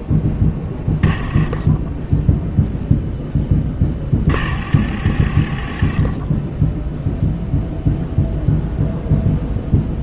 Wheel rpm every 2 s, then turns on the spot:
10, 10, 40, 0, 0.
none